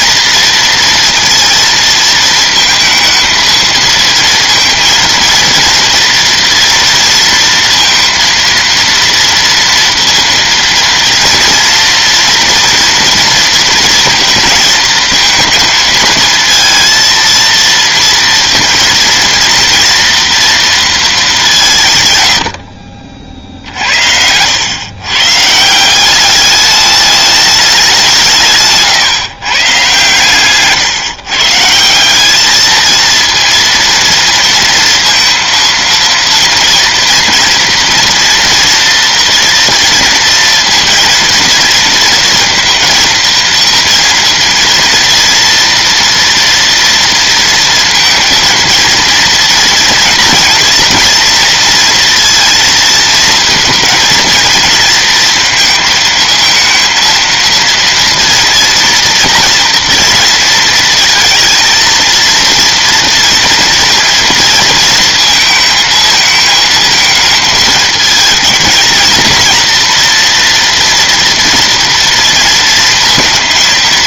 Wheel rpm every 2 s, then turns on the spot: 230, 230, 230, 230, 230, 230, 230, 230, 230, 230, 230, 100, 90, 200, 150, 140, 210, 230, 230, 230, 230, 230, 230, 230, 230, 230, 230, 230, 230, 230, 230, 230, 230, 220, 220, 240, 230.
none